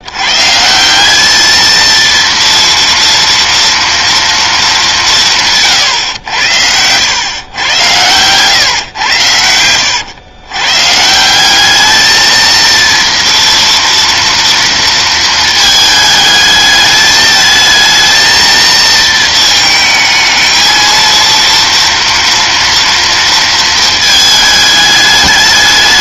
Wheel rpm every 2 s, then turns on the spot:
170, 230, 210, 90, 130, 130, 230, 230, 210, 230, 220, 230, 210.
none